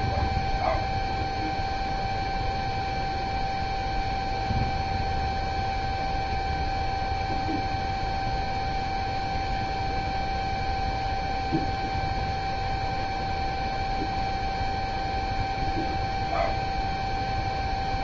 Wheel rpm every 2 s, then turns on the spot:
0, 0, 0, 0, 0, 0, 0, 0, 0.
none